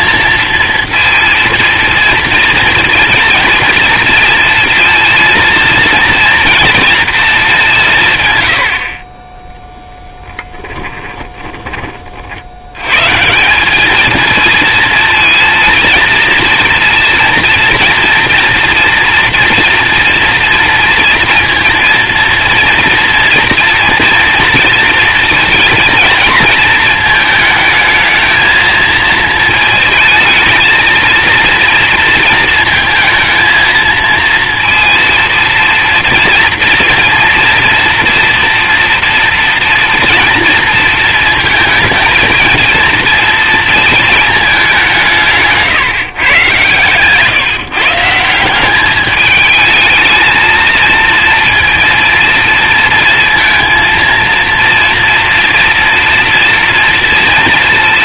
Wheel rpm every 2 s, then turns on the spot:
230, 230, 230, 230, 100, 10, 80, 230, 230, 230, 230, 230, 230, 220, 220, 220, 230, 230, 230, 230, 230, 230, 200, 120, 180, 230, 230, 230, 230.
10-12